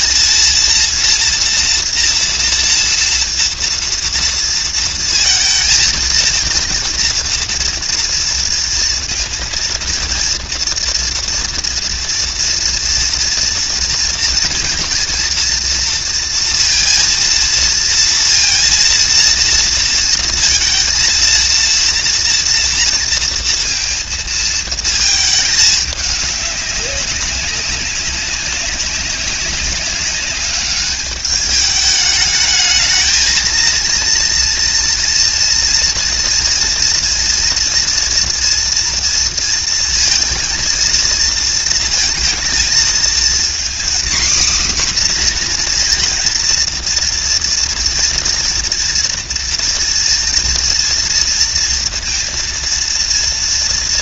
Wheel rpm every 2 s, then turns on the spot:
230, 230, 230, 230, 230, 240, 230, 230, 230, 230, 230, 230, 220, 200, 190, 200, 220, 240, 230, 240, 230, 230, 260, 230, 230, 230, 230.
none